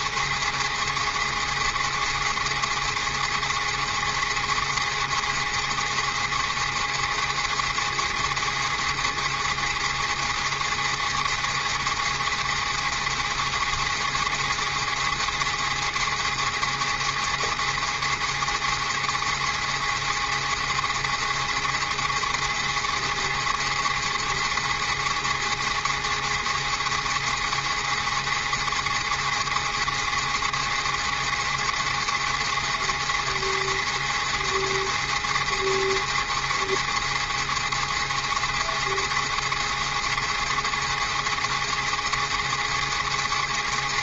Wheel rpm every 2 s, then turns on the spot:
290, 290, 290, 290, 290, 290, 290, 290, 290, 290, 290, 290, 290, 290, 290, 290, 290, 290, 290, 290, 290, 290.
none